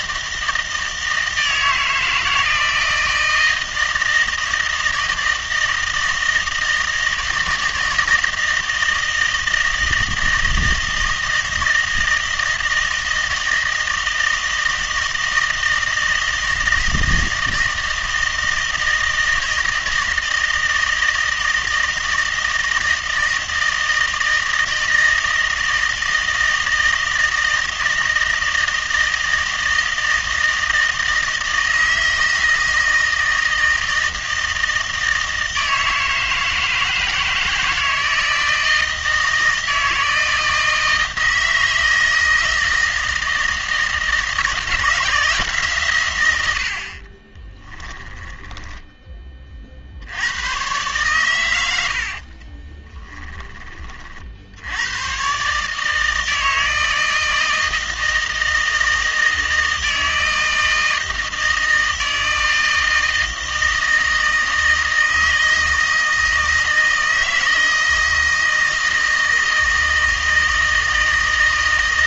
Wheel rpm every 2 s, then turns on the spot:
160, 160, 160, 160, 160, 160, 160, 160, 160, 160, 160, 160, 160, 160, 160, 160, 160, 160, 160, 160, 160, 160, 160, 70, 10, 120, 20, 90, 160, 160, 160, 160, 160, 160, 160, 160.
48-50 52-54